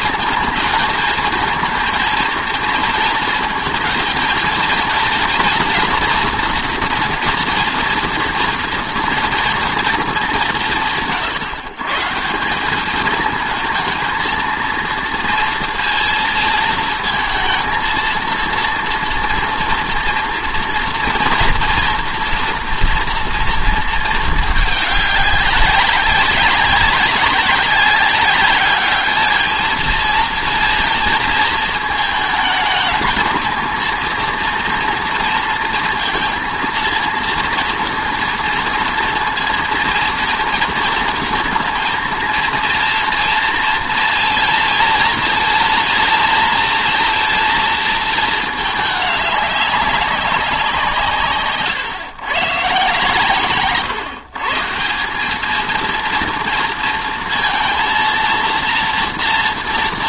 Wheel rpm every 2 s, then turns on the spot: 220, 230, 230, 230, 240, 170, 190, 230, 230, 230, 230, 240, 210, 190, 200, 230, 220, 230, 230, 230, 230, 230, 240, 230, 210, 180, 140, 160, 230, 230.
none